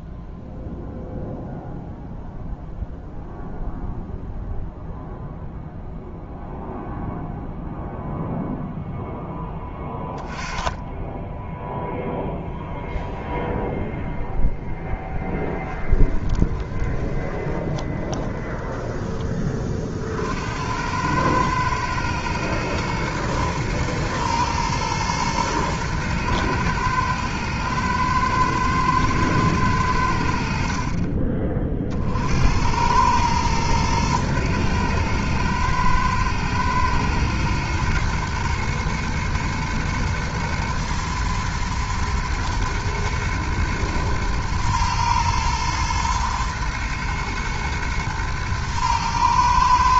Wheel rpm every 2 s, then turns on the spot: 0, 0, 0, 0, 10, 10, 0, 0, 20, 20, 100, 110, 110, 110, 110, 40, 110, 110, 110, 110, 110, 120, 120, 110, 110.
16-18